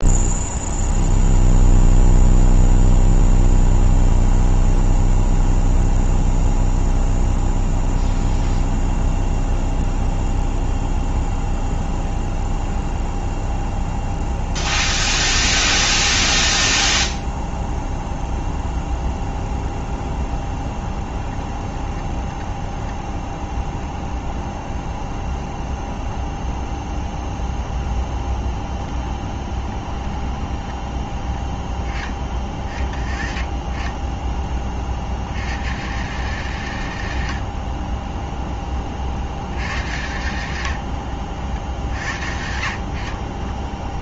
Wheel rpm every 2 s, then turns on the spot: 0, 0, 0, 0, 0, 0, 0, 0, 0, 0, 0, 10, 0, 0, 0, 10, 30, 20, 140, 20, 100, 60.
22-24